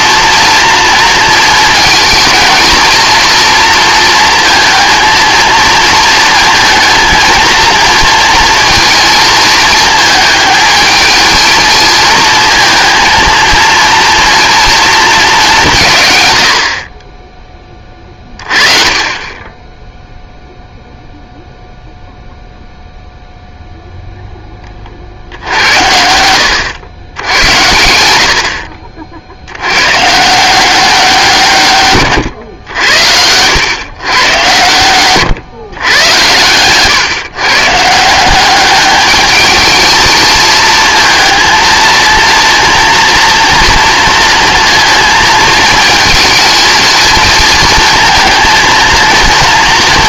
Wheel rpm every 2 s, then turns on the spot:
230, 230, 230, 220, 230, 220, 230, 230, 60, 30, 0, 0, 20, 100, 60, 170, 100, 110, 120, 200, 220, 230, 230, 220, 230.
none